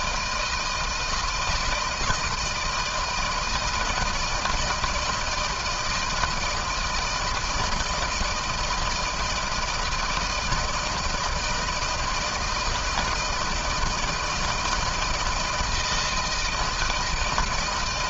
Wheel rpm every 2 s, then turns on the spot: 160, 170, 160, 160, 160, 160, 160, 160, 160.
none